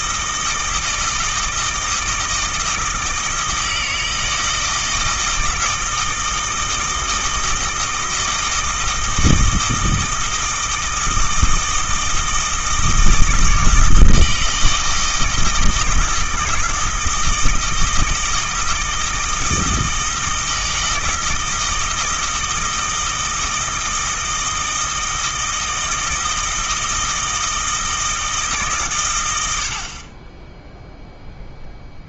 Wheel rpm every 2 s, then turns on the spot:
160, 160, 160, 160, 160, 160, 160, 160, 160, 160, 160, 160, 160, 160, 140, 0.
none